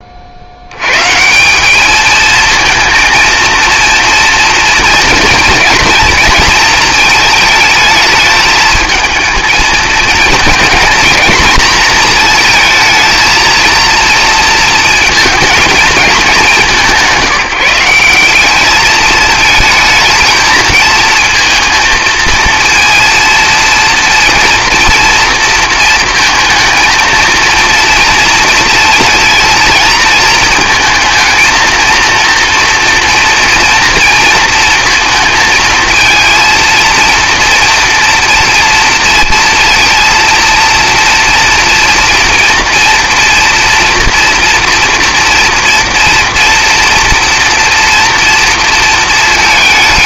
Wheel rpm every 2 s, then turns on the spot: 140, 230, 230, 220, 220, 240, 230, 230, 190, 210, 220, 230, 230, 230, 230, 220, 230, 230, 230, 230, 230, 240, 240, 230, 230.
none